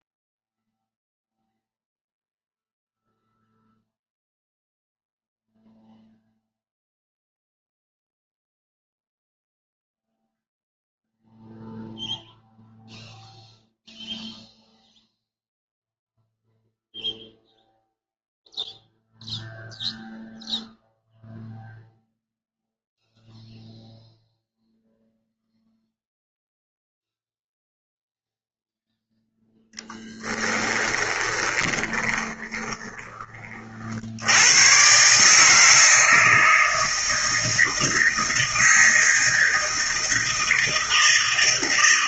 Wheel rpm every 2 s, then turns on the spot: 0, 0, 0, 0, 0, 0, 0, 0, 0, 0, 0, 0, 0, 0, 0, 20, 20, 120, 160, 160, 160.
30-34